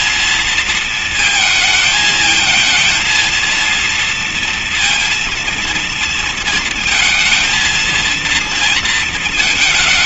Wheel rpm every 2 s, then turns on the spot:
230, 220, 230, 230, 230.
none